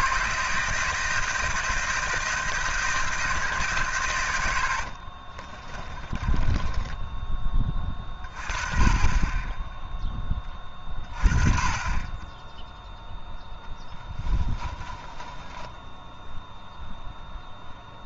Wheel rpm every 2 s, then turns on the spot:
160, 160, 60, 10, 30, 30, 10, 20, 0.
4-8 14-16